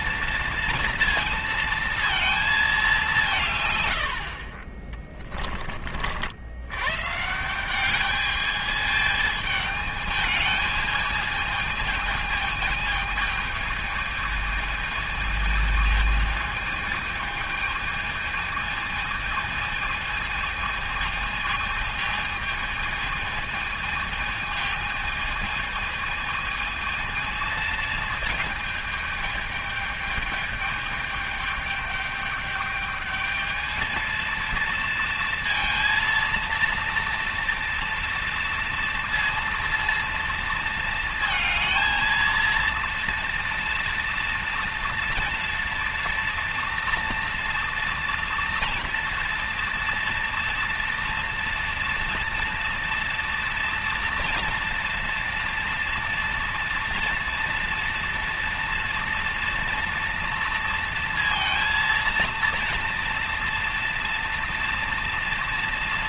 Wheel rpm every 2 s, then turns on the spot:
230, 200, 40, 130, 220, 220, 220, 220, 220, 220, 220, 220, 220, 220, 220, 210, 210, 230, 230, 230, 230, 230, 230, 230, 230, 230, 230, 230, 230, 230, 230, 230, 230.
4-6